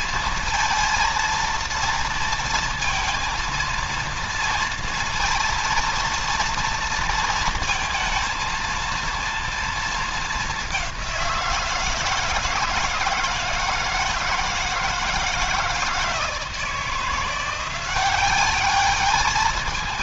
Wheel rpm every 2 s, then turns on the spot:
230, 230, 230, 230, 230, 190, 160, 160, 170, 210.
none